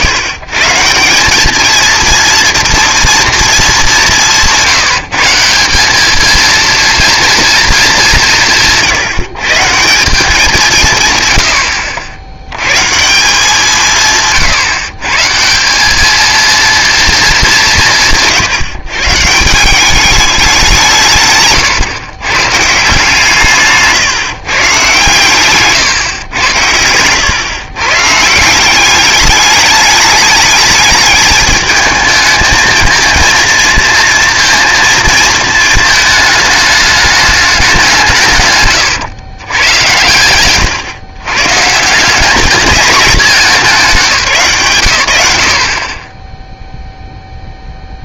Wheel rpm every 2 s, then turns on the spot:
150, 230, 180, 220, 160, 180, 100, 130, 230, 150, 190, 140, 130, 100, 170, 210, 220, 230, 210, 130, 110, 210, 150, 0.
none